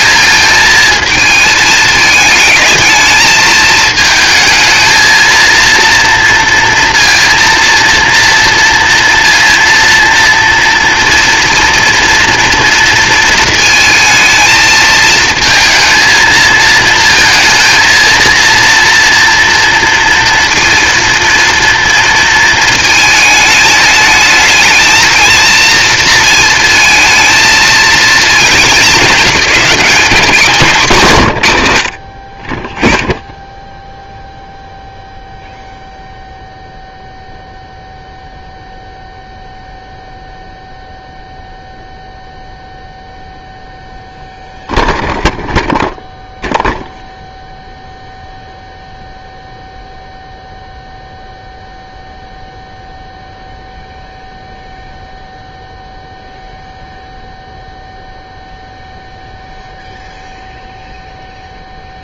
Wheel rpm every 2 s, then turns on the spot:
220, 220, 220, 230, 230, 230, 230, 220, 220, 230, 230, 220, 220, 220, 220, 190, 10, 0, 0, 0, 0, 0, 0, 0, 0, 0, 0, 0, 0, 0, 0.
none